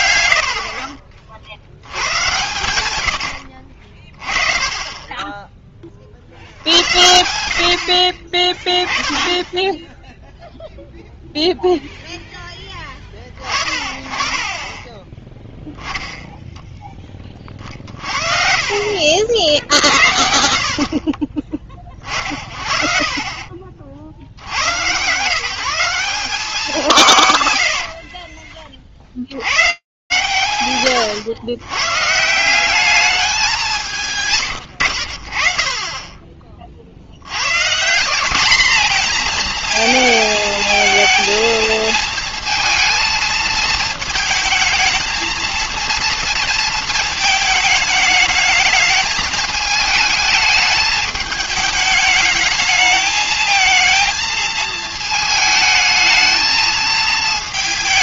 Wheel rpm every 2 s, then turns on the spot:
60, 100, 20, 70, 20, 0, 10, 20, 0, 50, 60, 50, 90, 190, 40, 110, 200, 60, 60, 230, 220, 220, 220, 230, 220, 210, 220, 220, 220.
2-4